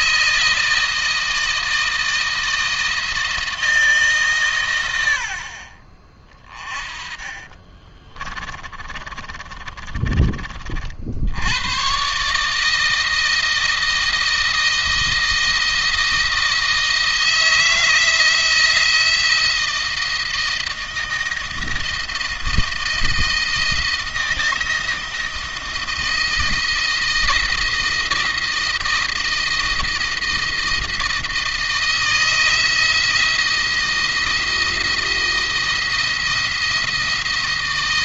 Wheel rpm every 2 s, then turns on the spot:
160, 160, 100, 30, 30, 50, 160, 160, 160, 170, 170, 170, 160, 160, 160, 160, 170, 170, 170.
6-10